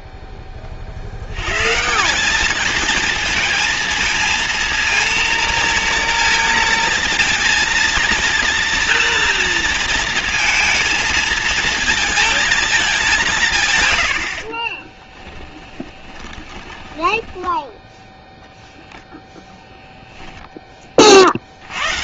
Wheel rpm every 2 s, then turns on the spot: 40, 220, 230, 230, 230, 230, 210, 20, 10, 0, 20.
14-18